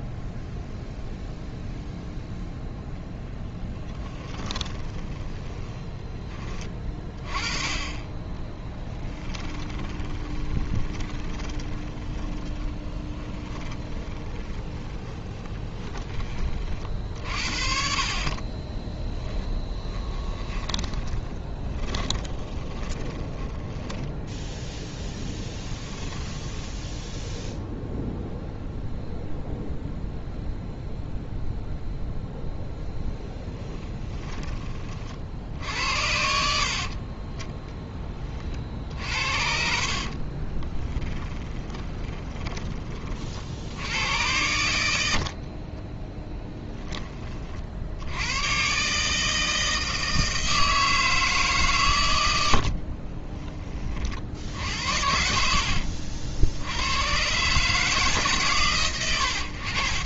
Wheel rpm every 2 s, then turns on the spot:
0, 10, 30, 30, 10, 20, 20, 20, 40, 20, 10, 20, 10, 10, 0, 0, 0, 30, 60, 50, 20, 30, 90, 10, 130, 160, 60, 60, 90, 130.
4-6 8-16 18-24 26-28 40-42 52-54